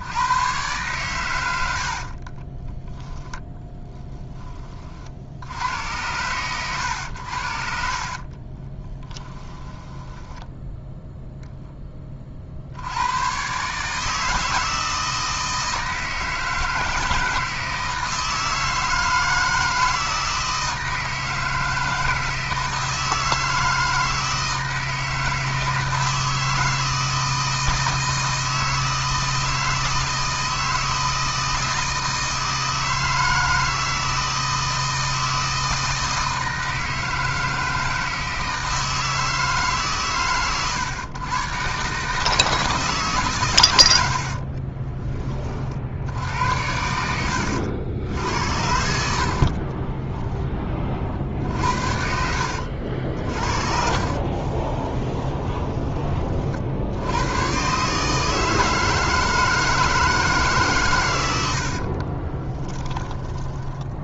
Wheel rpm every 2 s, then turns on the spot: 120, 10, 40, 110, 20, 10, 80, 160, 160, 160, 160, 160, 160, 160, 160, 160, 160, 160, 160, 160, 110, 150, 20, 90, 60, 20, 60, 10, 70, 160, 120, 20.
2-4 8-10 44-48 52-56 62-64